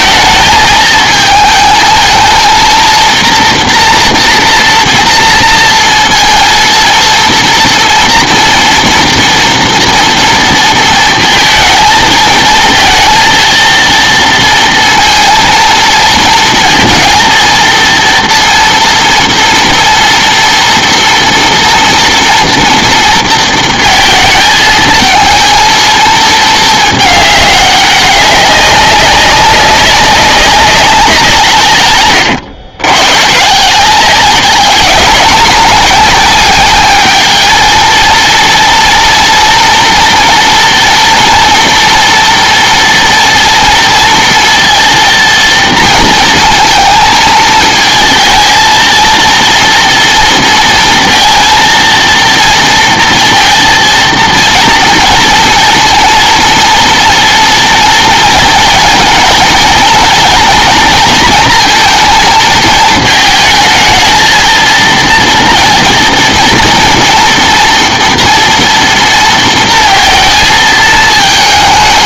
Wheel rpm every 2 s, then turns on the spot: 220, 230, 240, 230, 230, 230, 230, 230, 230, 230, 230, 230, 220, 220, 200, 190, 110, 200, 210, 230, 230, 230, 230, 230, 230, 230, 230, 230, 230, 230, 230, 220, 230, 230, 230, 220.
none